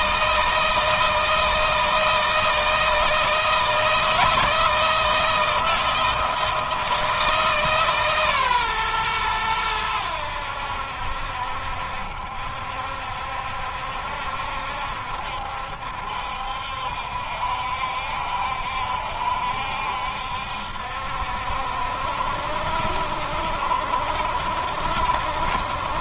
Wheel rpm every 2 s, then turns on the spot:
160, 160, 160, 160, 130, 80, 70, 70, 70, 70, 70, 70, 70.
none